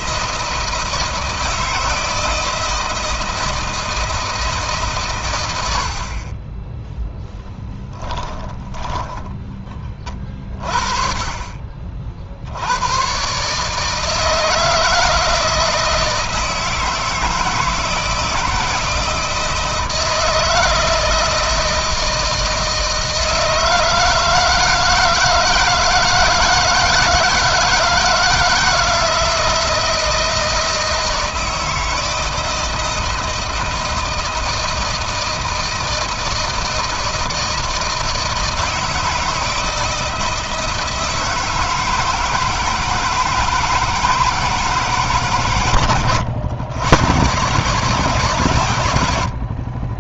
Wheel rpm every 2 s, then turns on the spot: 160, 160, 150, 30, 10, 20, 60, 160, 160, 160, 160, 160, 160, 160, 160, 160, 160, 160, 160, 160, 160, 160, 160, 100, 130.
8-10